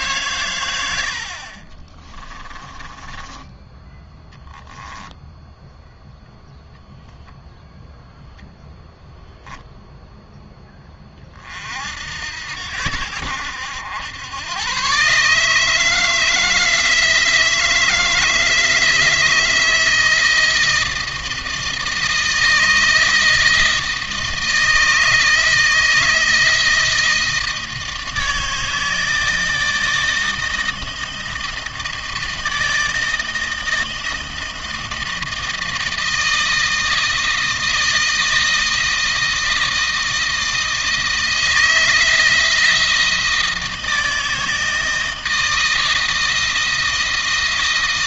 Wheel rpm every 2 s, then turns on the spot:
90, 20, 0, 0, 0, 20, 80, 120, 160, 160, 160, 160, 160, 160, 160, 160, 160, 160, 160, 160, 160, 160, 160, 160.
2-4